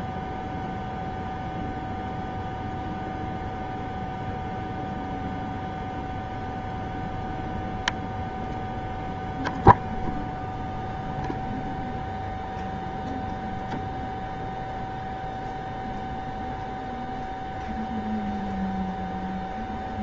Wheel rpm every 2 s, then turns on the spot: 0, 0, 0, 0, 0, 0, 0, 0, 0, 0.
none